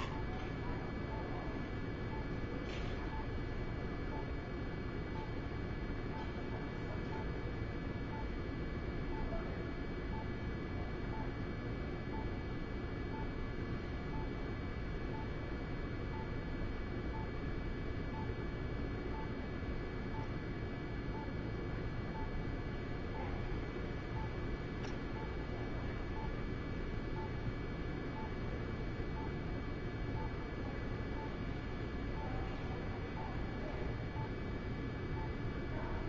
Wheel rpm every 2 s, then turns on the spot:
10, 0, 0, 0, 0, 0, 0, 0, 0, 0, 0, 0, 0, 0, 0, 0, 0, 0.
none